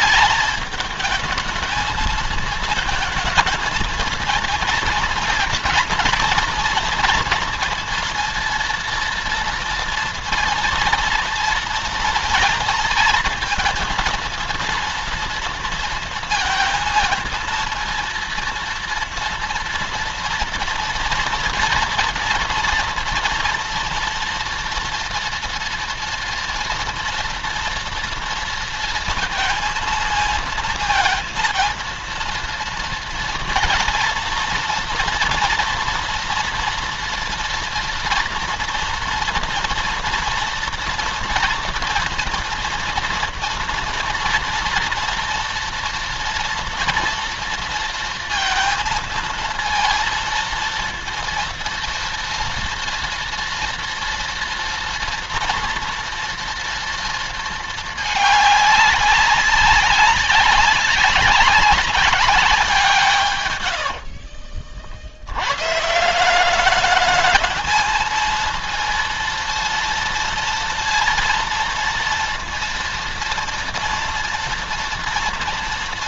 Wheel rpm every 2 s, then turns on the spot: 210, 220, 230, 230, 230, 230, 220, 230, 230, 230, 240, 230, 240, 230, 230, 230, 230, 230, 240, 230, 230, 240, 230, 230, 230, 230, 230, 230, 240, 200, 190, 180, 50, 190, 230, 230, 230, 230.
none